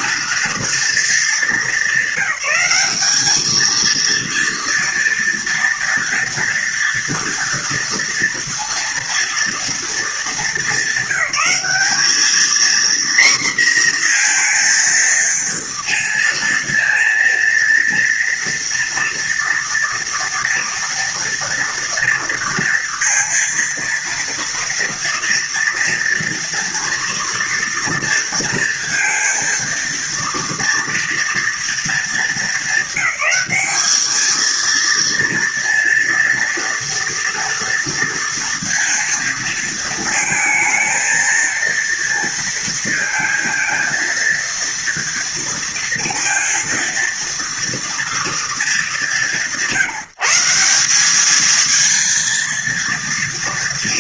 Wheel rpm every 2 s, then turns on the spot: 230, 200, 230, 230, 230, 220, 220, 240, 230, 230, 230, 230, 230, 230, 230, 230, 210, 220, 230, 230, 220, 230, 230, 230, 240, 180, 230.
none